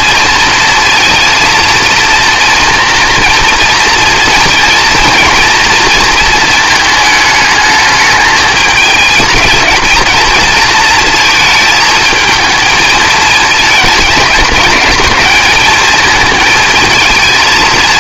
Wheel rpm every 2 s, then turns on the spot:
230, 230, 230, 220, 220, 230, 230, 210, 220.
none